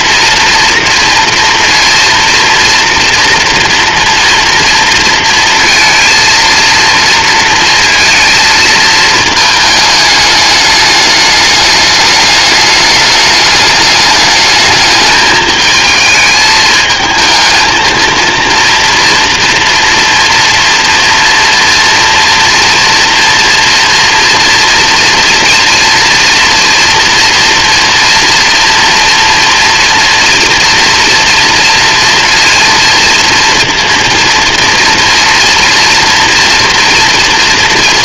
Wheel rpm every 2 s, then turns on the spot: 230, 230, 230, 230, 220, 210, 210, 220, 220, 240, 230, 230, 230, 230, 230, 240, 230, 230, 230.
none